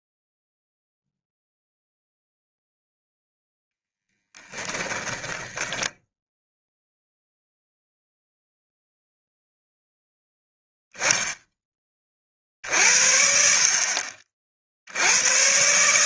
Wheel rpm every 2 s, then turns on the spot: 0, 0, 10, 0, 0, 0, 60, 70.
4-6